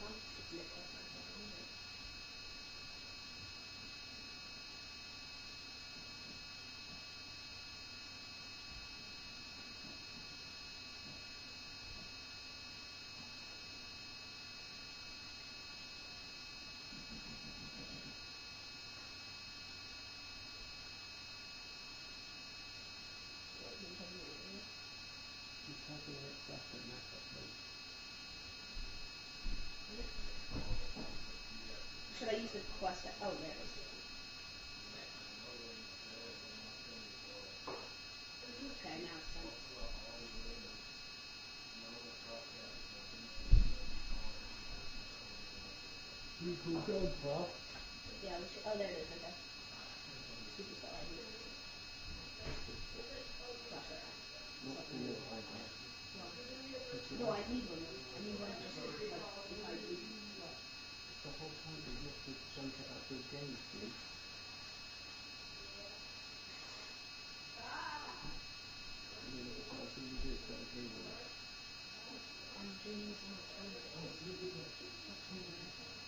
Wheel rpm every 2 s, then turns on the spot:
0, 0, 0, 0, 0, 0, 0, 0, 0, 0, 0, 0, 0, 0, 0, 0, 0, 0, 0, 0, 0, 0, 0, 0, 0, 0, 0, 0, 0, 0, 0, 0, 0, 0, 0, 0, 0, 0.
none